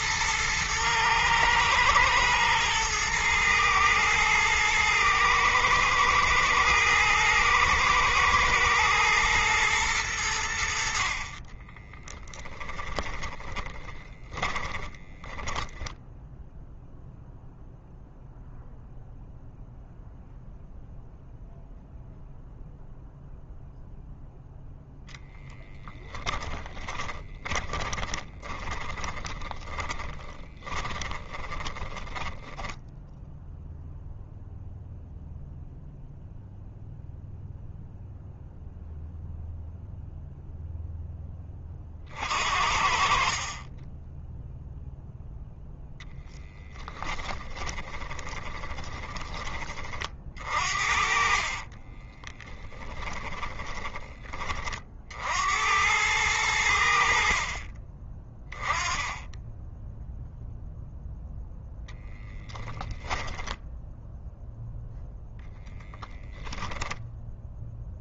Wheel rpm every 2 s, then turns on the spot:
110, 110, 110, 110, 120, 60, 10, 20, 0, 0, 0, 0, 10, 30, 40, 20, 10, 0, 0, 0, 10, 50, 0, 10, 20, 50, 10, 50, 70, 20, 0, 10, 0, 10.
12-16 26-34 46-54